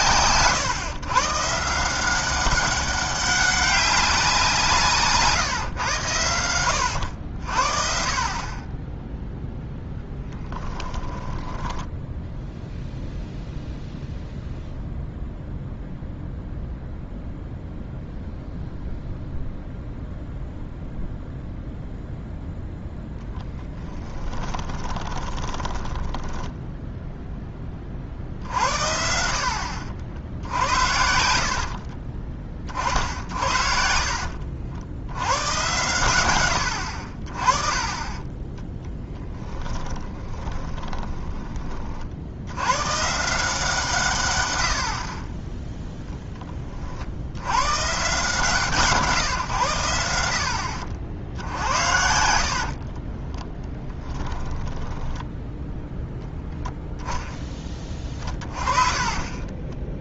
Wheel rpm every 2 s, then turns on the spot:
130, 200, 160, 90, 10, 10, 0, 0, 0, 0, 0, 0, 20, 0, 60, 80, 40, 80, 60, 10, 20, 110, 70, 40, 140, 60, 40, 10, 0, 30.
10-12 24-26 30-32 40-42 52-56 58-60